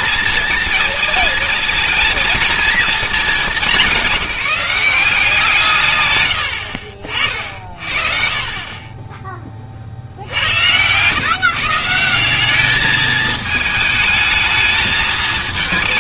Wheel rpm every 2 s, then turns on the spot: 230, 230, 180, 80, 30, 90, 200, 220.
none